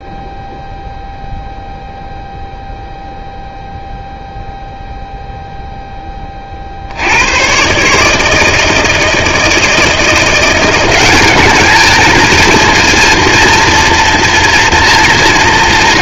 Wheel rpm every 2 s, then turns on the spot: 0, 0, 0, 30, 160, 180, 230, 230.
none